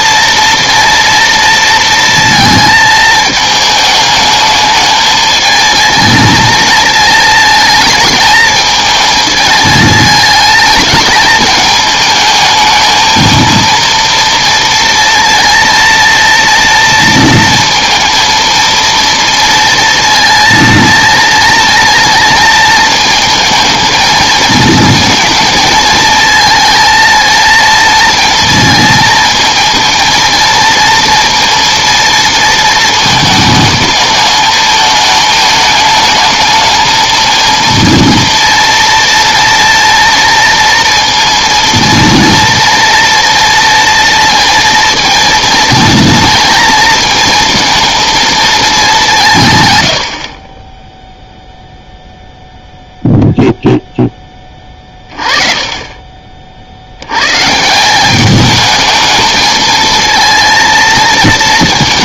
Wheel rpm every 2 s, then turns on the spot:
230, 220, 220, 230, 220, 220, 220, 230, 230, 230, 230, 230, 230, 230, 230, 230, 230, 220, 220, 240, 230, 230, 230, 230, 210, 20, 0, 20, 60, 220, 230.
none